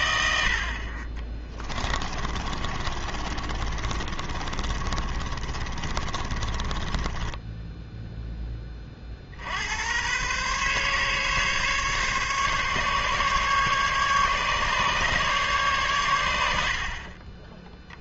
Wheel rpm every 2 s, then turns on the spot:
50, 30, 40, 20, 30, 140, 140, 140, 60.
2-8